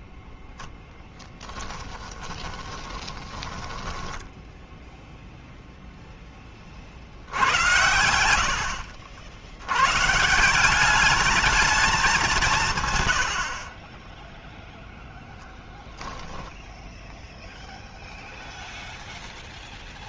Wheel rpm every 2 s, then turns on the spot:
0, 10, 10, 20, 80, 170, 170, 0, 10, 0.
2-6 8-10